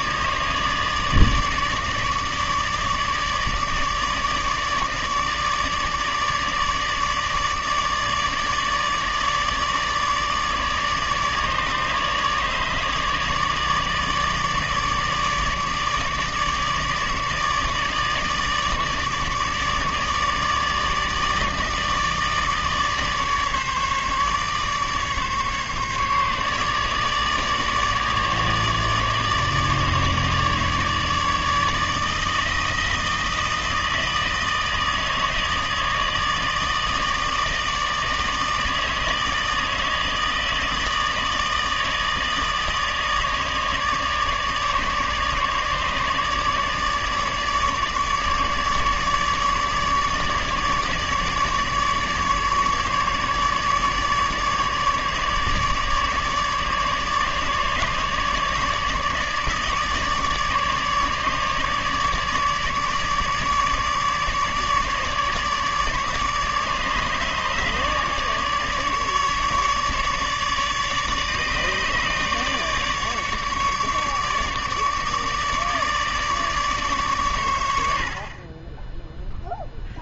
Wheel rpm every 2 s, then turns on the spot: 150, 150, 150, 150, 150, 150, 150, 150, 150, 150, 150, 150, 150, 150, 150, 150, 160, 160, 160, 160, 160, 150, 150, 150, 150, 150, 150, 150, 150, 150, 150, 150, 150, 150, 150, 150, 150, 150, 140, 10.
none